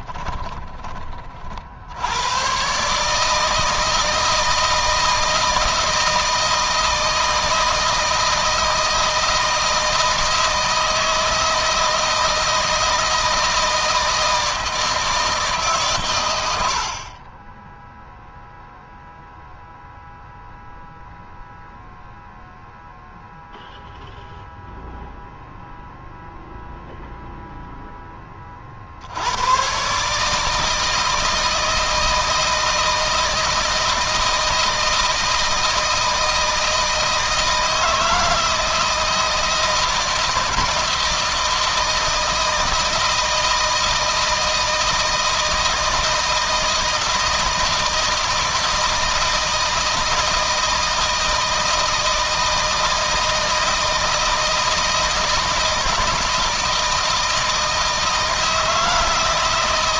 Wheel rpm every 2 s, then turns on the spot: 20, 100, 160, 160, 160, 160, 160, 160, 90, 0, 0, 0, 0, 0, 30, 160, 160, 160, 160, 160, 160, 160, 160, 160, 160, 160, 160, 160, 160, 160.
0-2